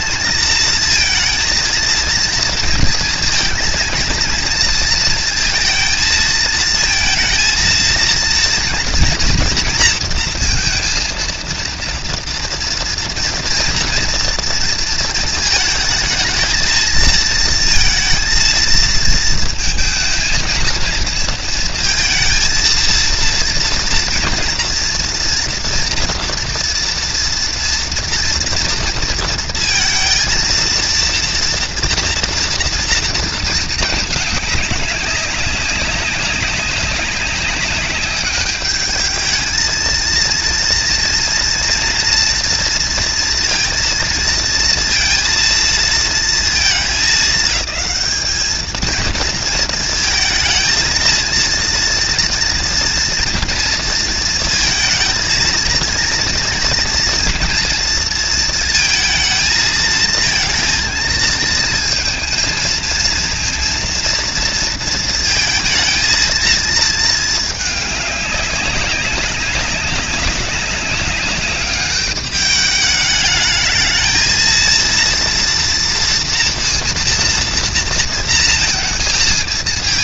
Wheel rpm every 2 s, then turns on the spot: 230, 230, 230, 220, 240, 230, 230, 230, 220, 230, 230, 230, 230, 230, 230, 230, 230, 200, 190, 210, 230, 230, 230, 220, 220, 230, 230, 220, 230, 230, 230, 230, 230, 220, 190, 200, 210, 230, 230, 220.
none